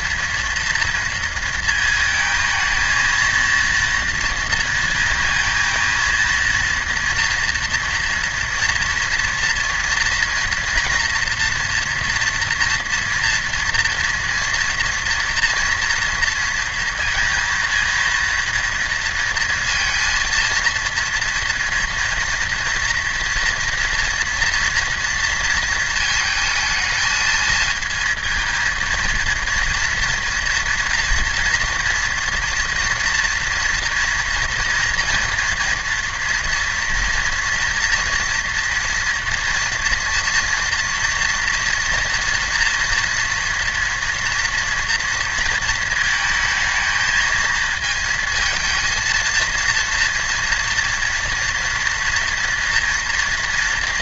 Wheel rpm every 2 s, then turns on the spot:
230, 220, 230, 230, 230, 240, 230, 230, 230, 230, 230, 240, 240, 230, 230, 230, 230, 230, 230, 230, 230, 240, 240, 220, 230, 230, 230.
none